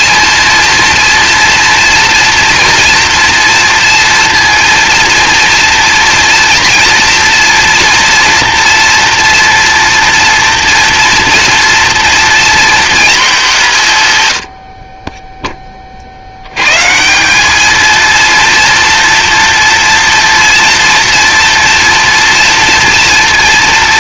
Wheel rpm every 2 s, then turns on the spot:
230, 230, 230, 230, 240, 230, 230, 40, 120, 240, 240, 230.
none